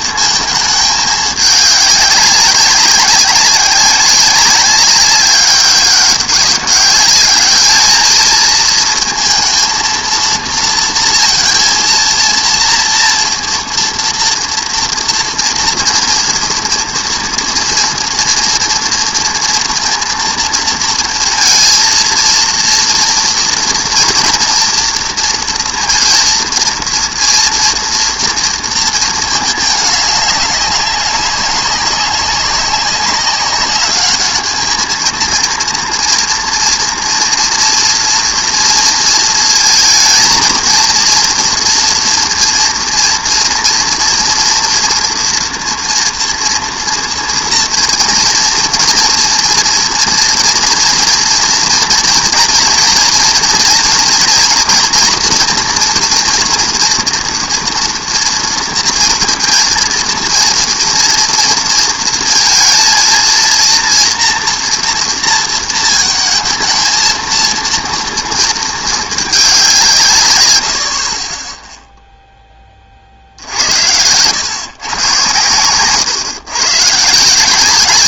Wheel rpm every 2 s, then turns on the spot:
220, 200, 190, 200, 220, 230, 230, 230, 230, 230, 230, 230, 240, 230, 230, 200, 190, 220, 230, 230, 230, 230, 230, 230, 230, 240, 230, 240, 240, 230, 230, 230, 240, 230, 220, 80, 20, 110, 130.
none